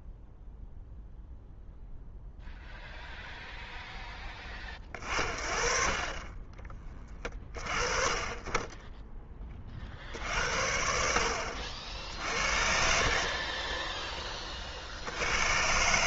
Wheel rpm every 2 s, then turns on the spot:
0, 0, 30, 20, 20, 50, 60, 30.
6-8